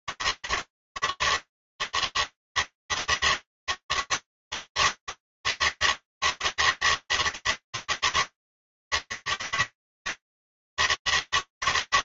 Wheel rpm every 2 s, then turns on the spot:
150, 160, 160, 160, 160, 160.
none